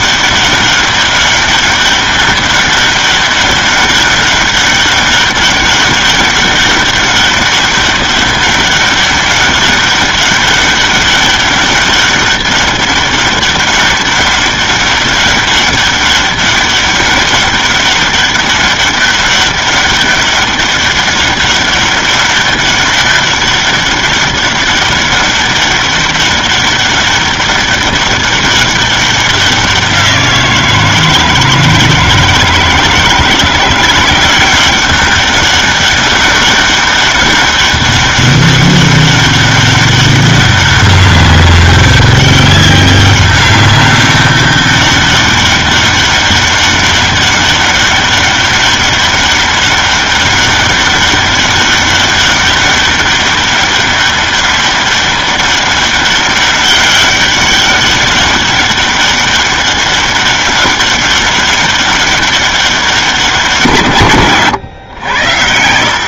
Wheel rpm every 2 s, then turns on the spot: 200, 200, 200, 200, 200, 200, 200, 200, 200, 200, 200, 200, 200, 200, 200, 170, 160, 180, 200, 200, 200, 200, 200, 200, 200, 200, 200, 200, 200, 200, 200, 200, 120.
none